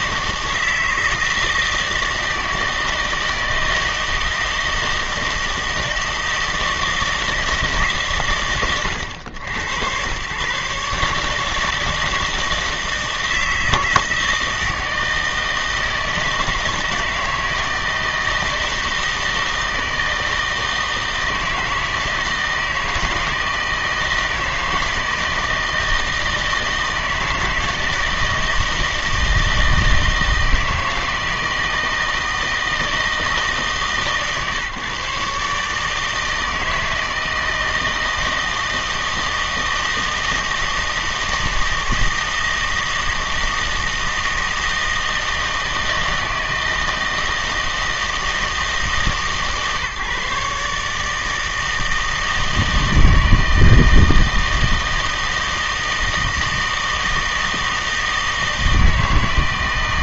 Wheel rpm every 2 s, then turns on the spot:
160, 160, 160, 160, 110, 140, 160, 160, 160, 160, 160, 160, 160, 160, 160, 160, 160, 150, 160, 160, 160, 160, 160, 160, 160, 150, 160, 160, 160, 160.
none